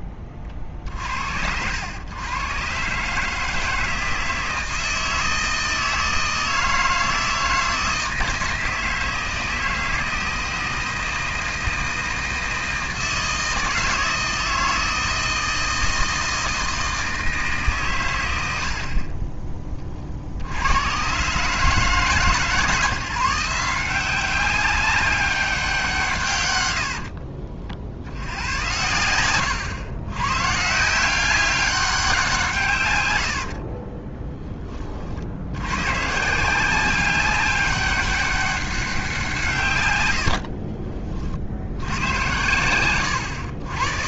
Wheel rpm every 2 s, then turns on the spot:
40, 120, 160, 160, 160, 160, 160, 160, 160, 80, 90, 140, 190, 110, 80, 140, 150, 20, 170, 200, 60, 110.
40-44